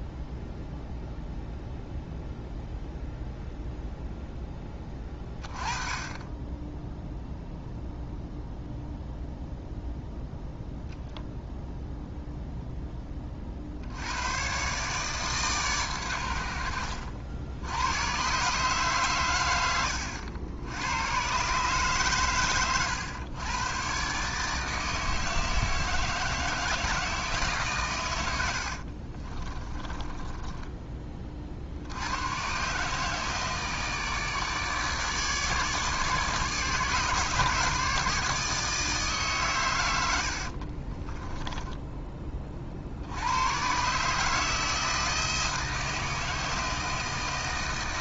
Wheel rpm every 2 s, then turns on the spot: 0, 0, 20, 0, 0, 0, 10, 140, 70, 140, 110, 120, 160, 160, 50, 30, 150, 150, 150, 150, 40, 70, 160, 160.
28-30 40-42